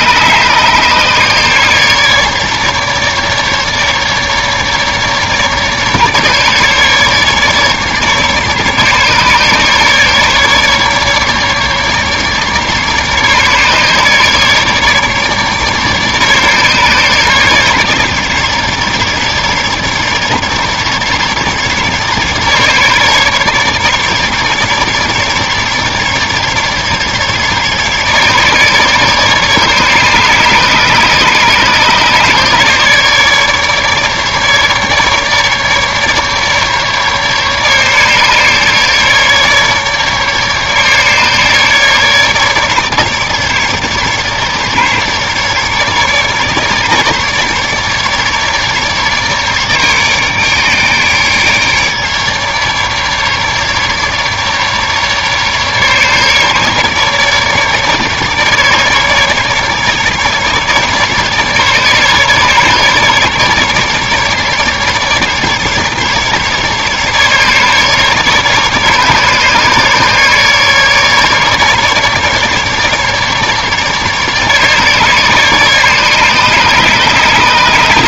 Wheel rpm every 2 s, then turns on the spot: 150, 150, 150, 150, 150, 150, 150, 150, 150, 150, 150, 150, 150, 150, 150, 150, 140, 150, 150, 150, 150, 150, 150, 150, 150, 150, 150, 150, 150, 150, 150, 150, 150, 150, 150, 150, 150, 150, 150.
none